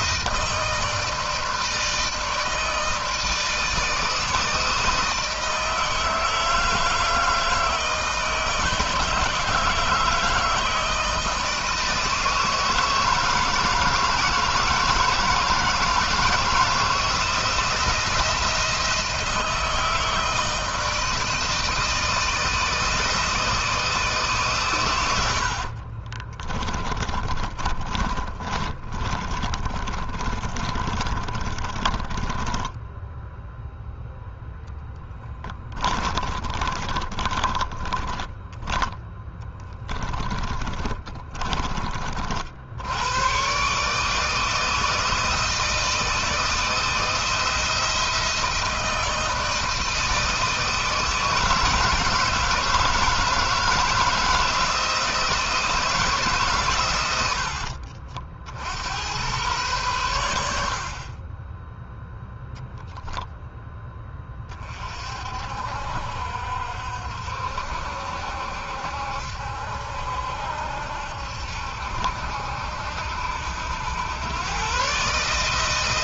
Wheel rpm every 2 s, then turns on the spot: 160, 160, 160, 160, 160, 160, 160, 160, 160, 170, 160, 160, 110, 20, 30, 30, 20, 0, 20, 10, 20, 90, 160, 160, 160, 160, 160, 160, 140, 80, 60, 0, 40, 60, 70, 70, 80, 130.
26-34 36-38 40-42